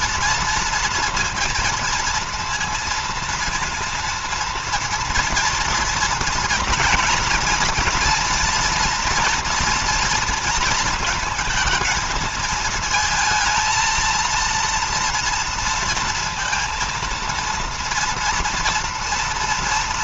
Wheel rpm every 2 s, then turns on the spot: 230, 230, 230, 240, 230, 230, 220, 230, 230, 230.
none